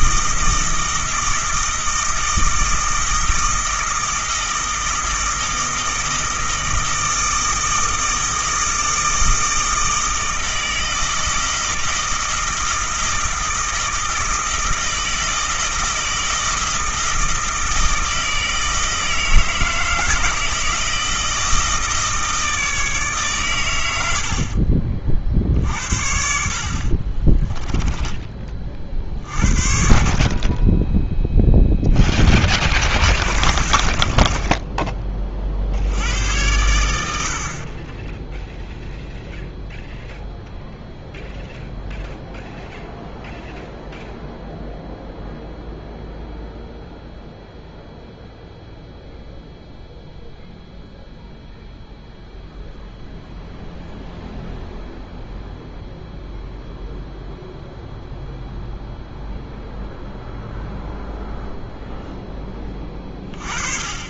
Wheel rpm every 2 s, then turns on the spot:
160, 160, 160, 160, 160, 160, 160, 160, 160, 160, 160, 150, 40, 50, 40, 10, 0, 10, 90, 0, 0, 0, 0, 0, 0, 0, 0, 0, 0, 0, 0, 20.
26-28